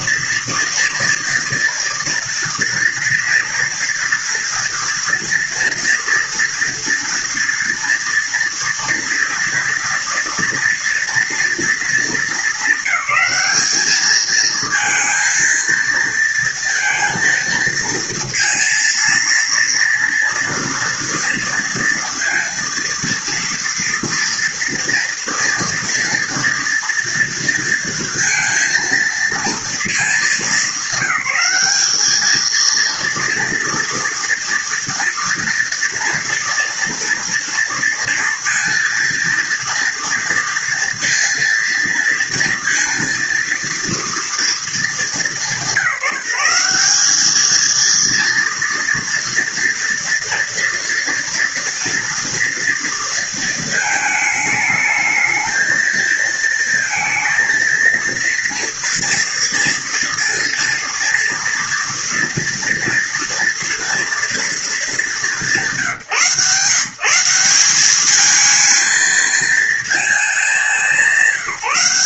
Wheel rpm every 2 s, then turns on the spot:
230, 230, 230, 230, 230, 230, 220, 220, 230, 230, 240, 230, 230, 230, 230, 210, 220, 230, 230, 230, 230, 230, 230, 180, 230, 230, 230, 220, 220, 230, 240, 230, 220, 150, 210, 210.
none